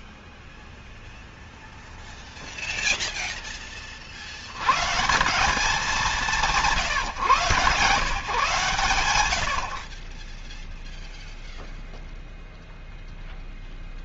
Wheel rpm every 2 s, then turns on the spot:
0, 0, 150, 140, 120, 0, 0.
none